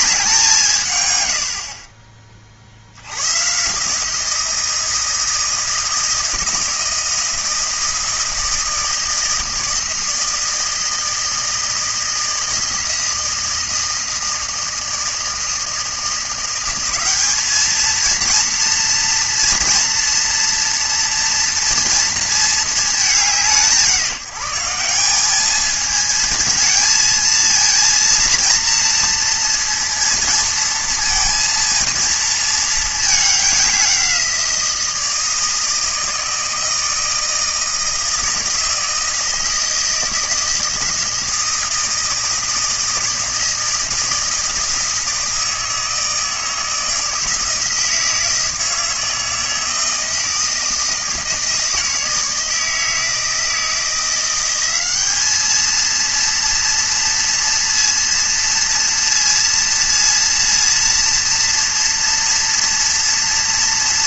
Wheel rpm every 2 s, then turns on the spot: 130, 80, 170, 160, 160, 160, 160, 160, 200, 230, 230, 210, 200, 220, 230, 230, 210, 170, 160, 160, 160, 160, 160, 160, 160, 160, 160, 200, 230, 230, 230, 230.
none